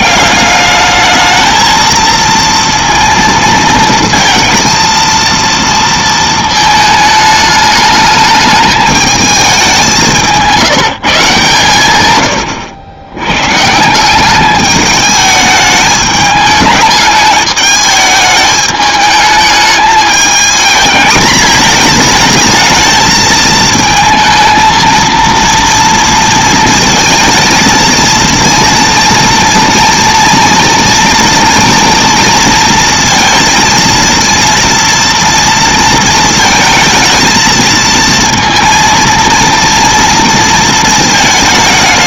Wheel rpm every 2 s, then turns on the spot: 200, 230, 230, 220, 210, 180, 100, 200, 210, 220, 220, 220, 230, 230, 230, 230, 230, 230, 220, 230, 230.
none